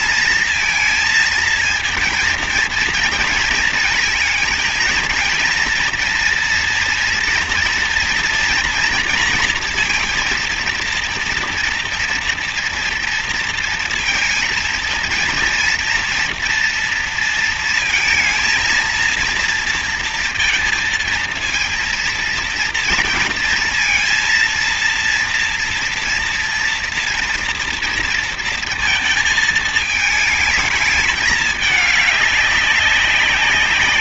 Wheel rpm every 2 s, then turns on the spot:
230, 230, 220, 230, 230, 230, 230, 230, 230, 230, 230, 230, 230, 230, 230, 220, 200.
none